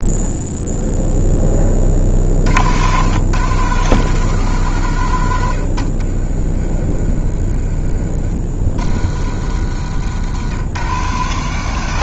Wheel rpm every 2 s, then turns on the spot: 0, 110, 120, 30, 70, 130.
none